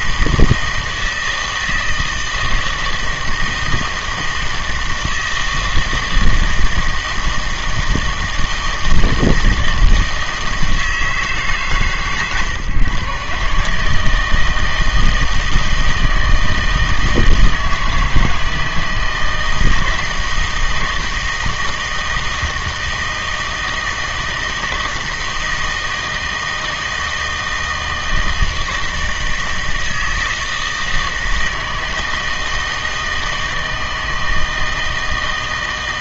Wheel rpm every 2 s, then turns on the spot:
160, 160, 160, 160, 160, 160, 130, 160, 160, 160, 160, 160, 160, 160, 160, 160, 160, 160.
none